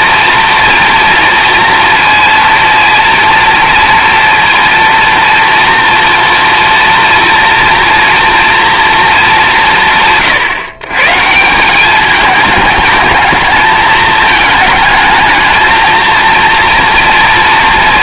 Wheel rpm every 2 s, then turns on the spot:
230, 230, 230, 230, 210, 160, 220, 220, 230.
none